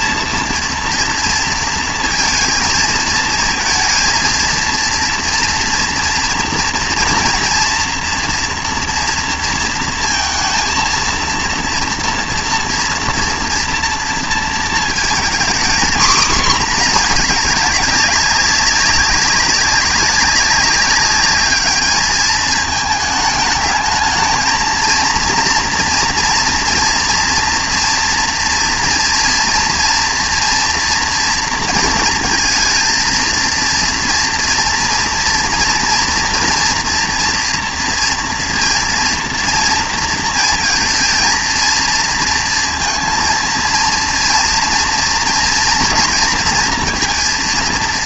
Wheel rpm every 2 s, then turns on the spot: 230, 230, 230, 240, 240, 230, 230, 230, 240, 200, 200, 220, 230, 240, 240, 230, 230, 240, 230, 230, 230, 230, 230, 240.
none